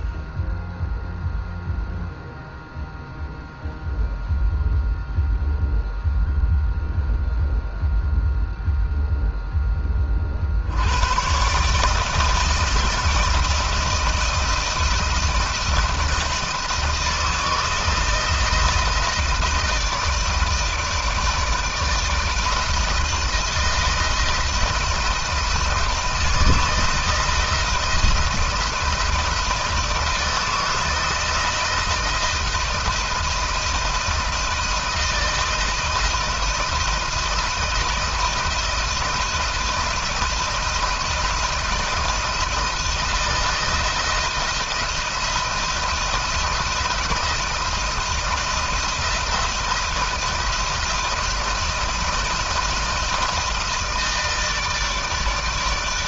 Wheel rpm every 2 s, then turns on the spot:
0, 0, 0, 0, 0, 50, 160, 160, 160, 160, 160, 160, 160, 160, 160, 160, 170, 160, 170, 160, 170, 160, 170, 170, 170, 160, 160, 160.
none